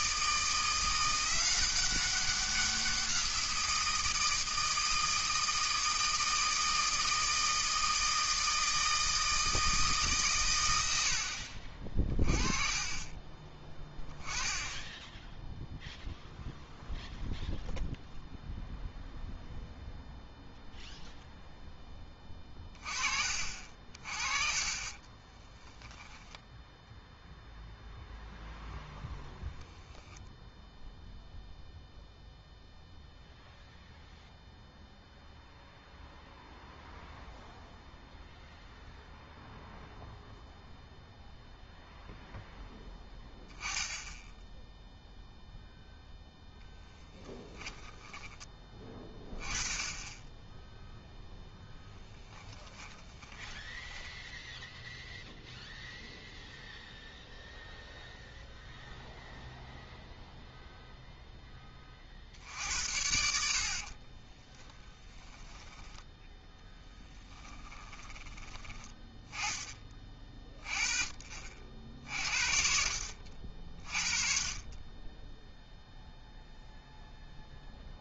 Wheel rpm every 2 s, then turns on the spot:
170, 190, 160, 160, 160, 110, 30, 10, 0, 0, 0, 20, 30, 10, 0, 0, 0, 0, 0, 0, 0, 10, 0, 0, 20, 0, 10, 0, 0, 0, 0, 70, 10, 10, 20, 30, 60, 30, 0.
24-26 52-54 64-68